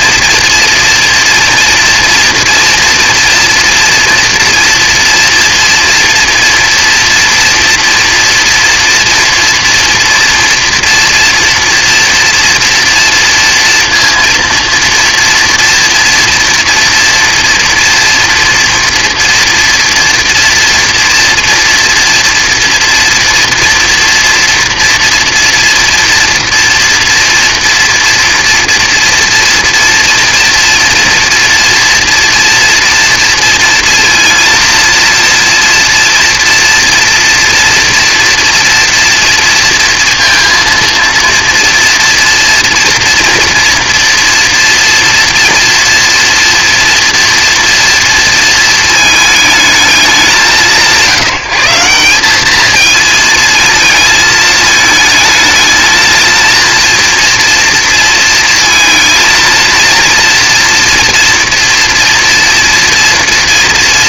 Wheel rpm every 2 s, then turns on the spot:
240, 230, 230, 240, 230, 230, 230, 230, 230, 230, 230, 230, 230, 230, 230, 230, 230, 230, 240, 240, 230, 230, 230, 230, 230, 180, 190, 220, 230, 230, 230, 230.
none